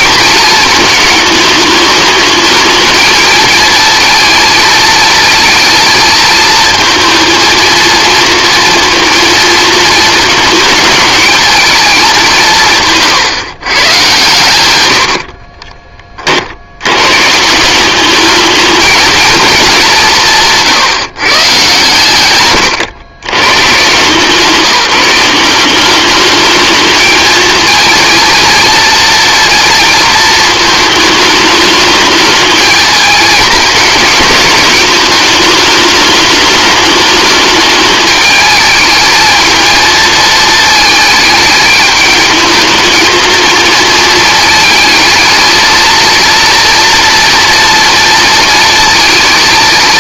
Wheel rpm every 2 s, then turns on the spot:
220, 220, 230, 220, 230, 220, 160, 90, 90, 210, 160, 110, 170, 210, 230, 220, 220, 210, 210, 220, 220, 220, 220, 230, 230.
14-16